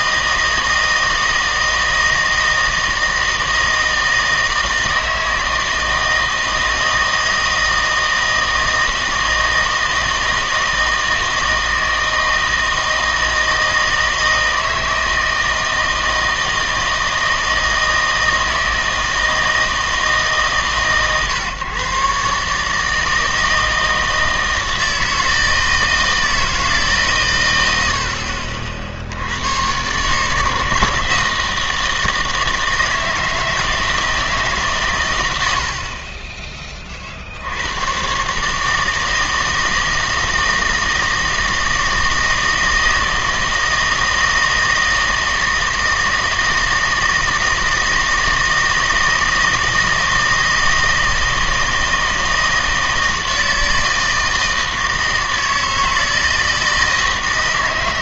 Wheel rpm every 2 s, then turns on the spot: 160, 160, 160, 160, 160, 160, 160, 160, 160, 160, 150, 150, 160, 160, 50, 160, 160, 140, 20, 150, 160, 160, 160, 160, 160, 160, 160, 160, 160.
none